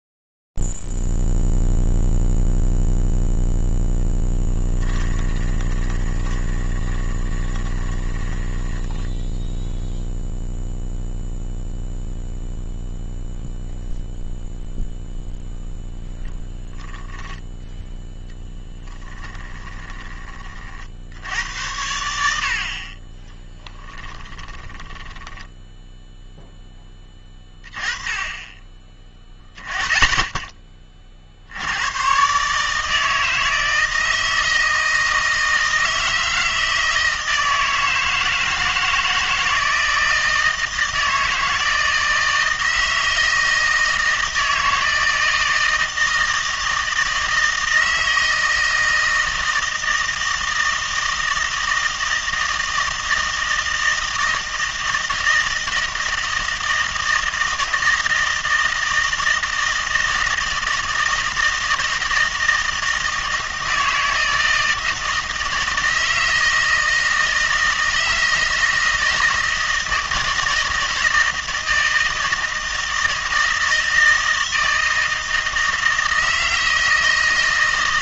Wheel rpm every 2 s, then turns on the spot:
0, 0, 10, 20, 10, 0, 0, 0, 0, 10, 40, 60, 10, 10, 20, 30, 150, 160, 160, 160, 160, 160, 160, 160, 160, 160, 160, 160, 160, 160, 160, 160, 160, 160, 160, 160, 160, 160, 160.
4-10 18-20 24-26